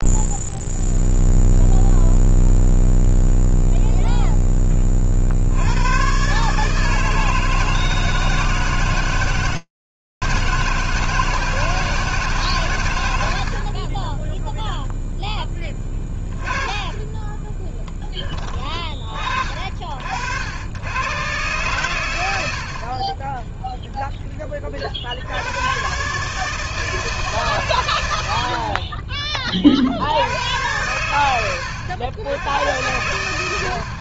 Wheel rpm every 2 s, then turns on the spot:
0, 0, 10, 150, 160, 160, 70, 10, 20, 30, 100, 50, 40, 160, 40, 110, 110.
16-18 28-30